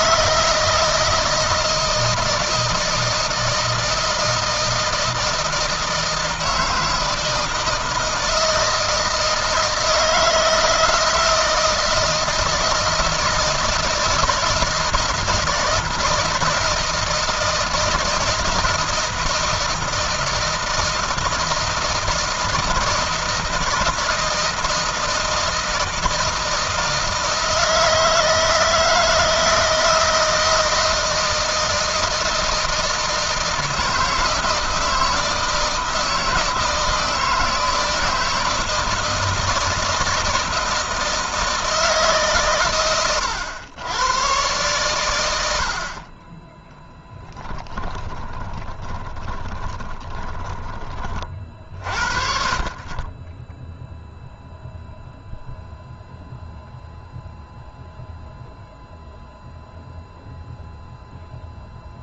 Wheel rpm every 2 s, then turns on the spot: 160, 160, 160, 160, 160, 160, 160, 160, 160, 160, 160, 160, 160, 160, 160, 160, 160, 160, 160, 160, 160, 120, 100, 10, 20, 30, 30, 0, 0, 0, 0.
48-50